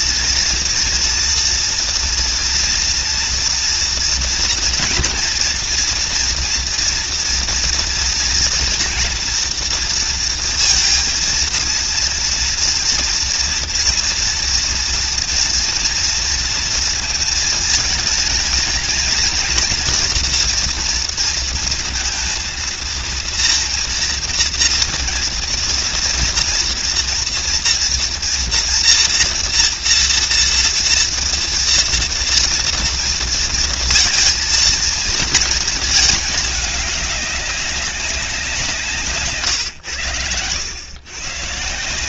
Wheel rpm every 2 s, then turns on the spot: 230, 230, 230, 230, 230, 230, 230, 230, 230, 230, 230, 230, 240, 230, 240, 230, 230, 230, 210, 170, 100.
none